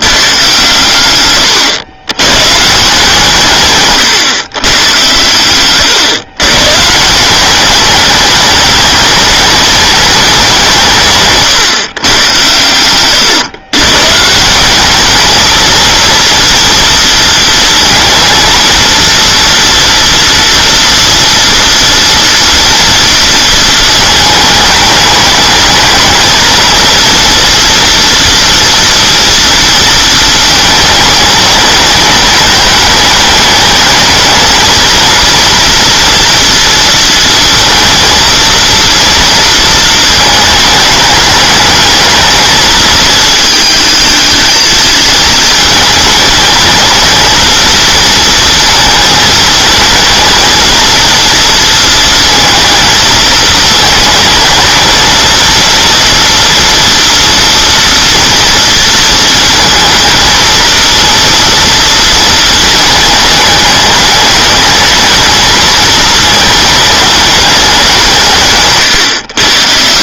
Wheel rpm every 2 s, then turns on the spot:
130, 150, 120, 130, 210, 180, 110, 190, 230, 230, 230, 230, 220, 230, 230, 220, 210, 220, 230, 230, 220, 220, 220, 220, 220, 220, 220, 230, 230, 230, 220, 210, 220, 210, 130.
12-14